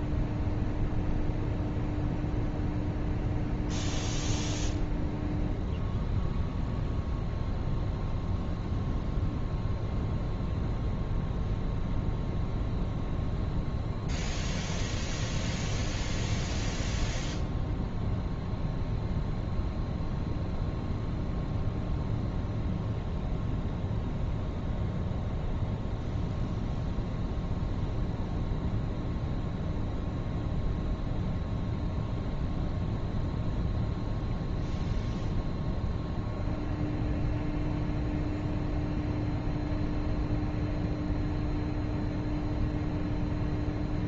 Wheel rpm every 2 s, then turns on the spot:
0, 0, 0, 0, 0, 0, 0, 0, 0, 0, 0, 0, 0, 0, 0, 0, 0, 0, 0, 0, 0, 0.
none